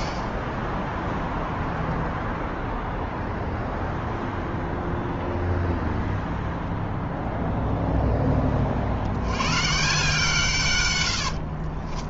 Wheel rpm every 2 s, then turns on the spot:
0, 0, 0, 0, 90, 60.
10-12